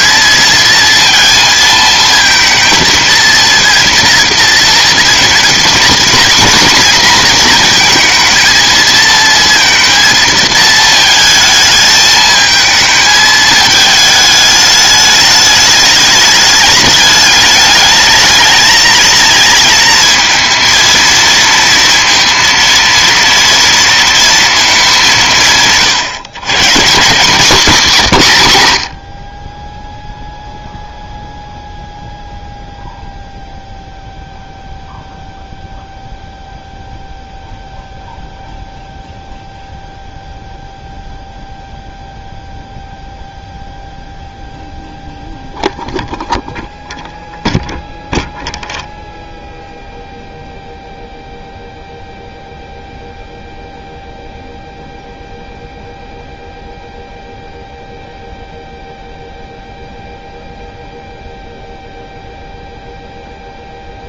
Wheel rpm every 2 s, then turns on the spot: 230, 220, 230, 240, 230, 220, 220, 210, 210, 220, 230, 230, 220, 160, 150, 0, 0, 0, 0, 0, 0, 0, 0, 0, 0, 0, 0, 0, 0, 0, 0, 0.
none